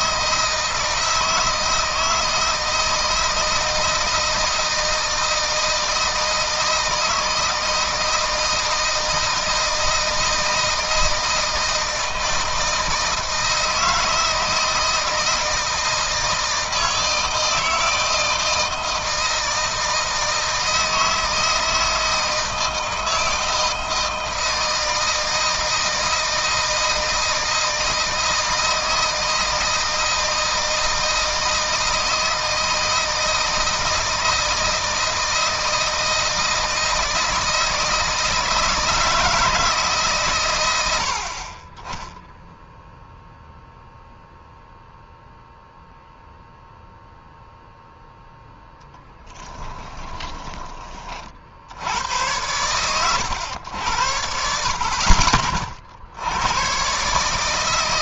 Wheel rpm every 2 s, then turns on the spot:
160, 160, 160, 160, 160, 160, 160, 160, 160, 160, 160, 160, 160, 160, 160, 160, 160, 160, 160, 160, 90, 0, 0, 0, 0, 20, 100, 60, 130.
none